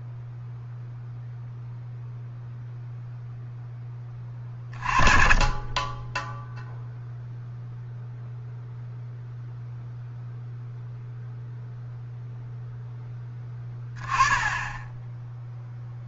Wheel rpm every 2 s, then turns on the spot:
0, 0, 40, 0, 0, 0, 0, 10.
none